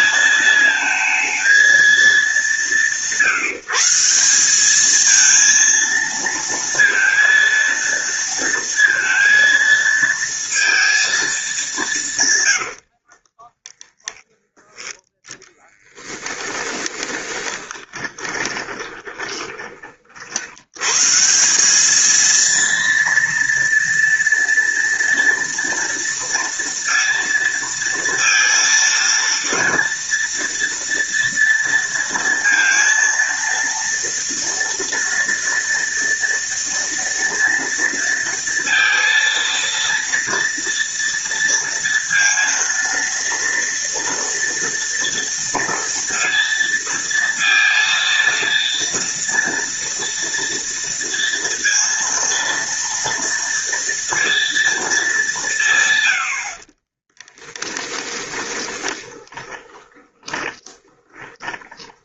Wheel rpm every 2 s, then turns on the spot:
220, 170, 200, 230, 230, 230, 90, 10, 20, 20, 120, 230, 230, 230, 230, 230, 230, 230, 230, 230, 230, 230, 230, 230, 230, 230, 230, 230, 40, 20, 20.
12-20 56-62